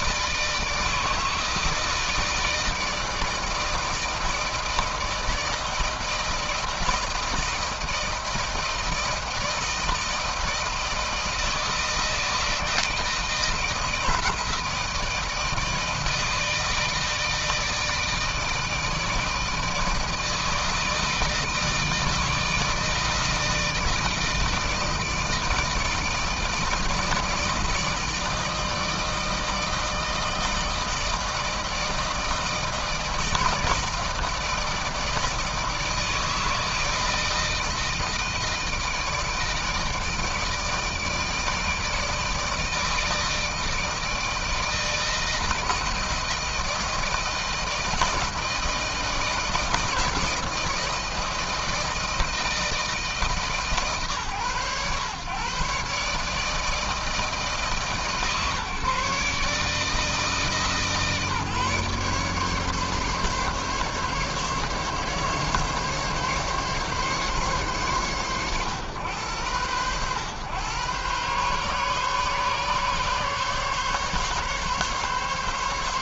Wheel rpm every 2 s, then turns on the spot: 160, 160, 160, 160, 160, 160, 160, 160, 160, 160, 160, 160, 160, 160, 160, 160, 160, 160, 160, 160, 160, 160, 160, 160, 160, 160, 160, 130, 160, 150, 150, 140, 140, 140, 110, 120, 140, 140.
none